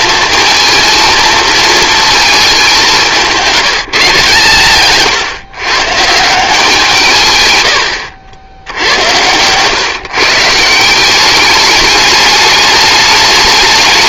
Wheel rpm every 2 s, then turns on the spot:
220, 200, 140, 170, 90, 160, 210.
8-10